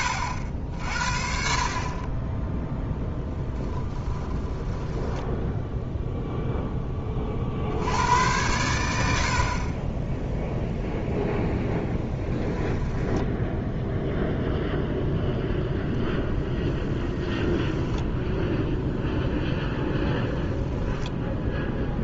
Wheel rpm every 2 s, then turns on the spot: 60, 0, 10, 20, 90, 0, 10, 0, 10, 0, 10.
4-6 12-14 20-22